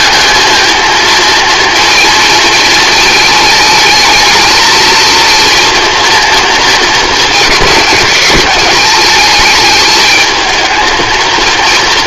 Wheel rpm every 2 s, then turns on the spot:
220, 220, 220, 230, 200, 220.
none